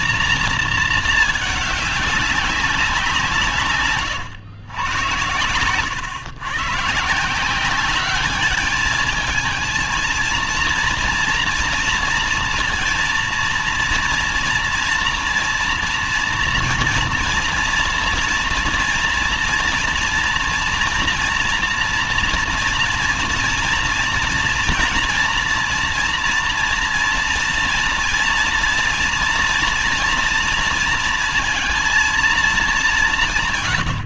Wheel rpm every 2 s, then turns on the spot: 230, 190, 110, 120, 210, 230, 230, 230, 230, 230, 230, 230, 230, 230, 230, 230, 210.
none